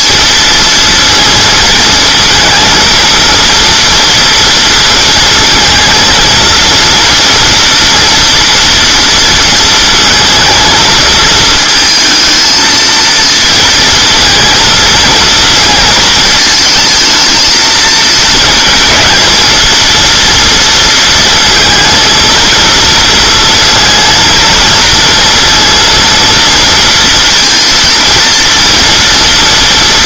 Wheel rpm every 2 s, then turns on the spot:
230, 220, 230, 230, 230, 230, 230, 220, 220, 230, 230, 230, 230, 230, 230.
none